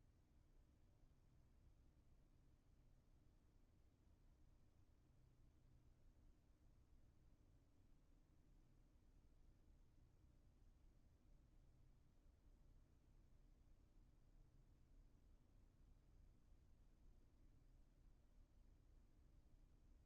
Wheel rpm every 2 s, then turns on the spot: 0, 0, 0, 0, 0, 0, 0, 0, 0, 0.
none